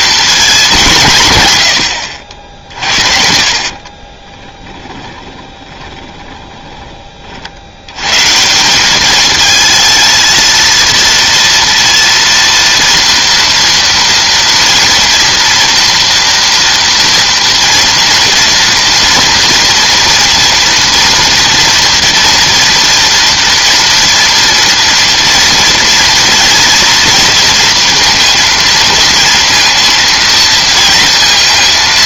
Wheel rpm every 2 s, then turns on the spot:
200, 50, 10, 20, 190, 230, 230, 230, 230, 240, 230, 230, 230, 230, 230, 230.
2-6